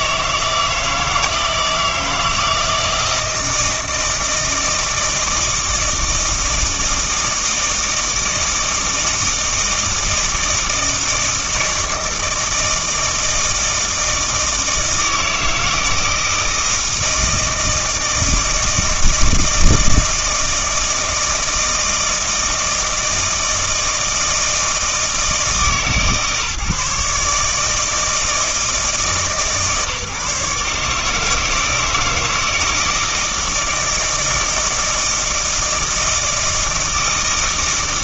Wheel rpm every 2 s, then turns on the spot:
160, 160, 160, 160, 160, 160, 160, 160, 160, 160, 160, 160, 160, 150, 150, 150, 160, 160, 160.
none